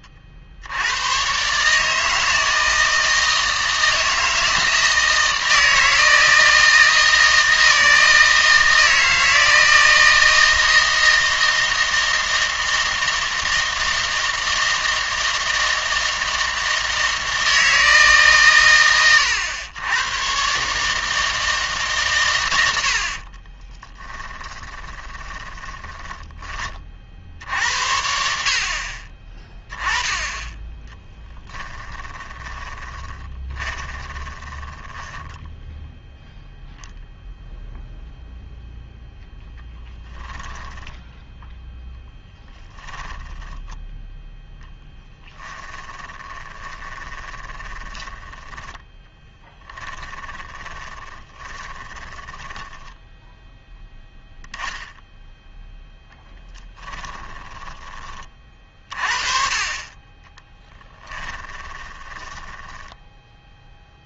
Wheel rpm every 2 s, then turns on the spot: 70, 160, 160, 160, 160, 160, 160, 160, 160, 130, 140, 90, 20, 30, 50, 10, 20, 10, 10, 0, 0, 10, 0, 20, 10, 10, 10, 0, 10, 40, 10, 20.
24-26 32-36 42-44 46-54 56-58 60-64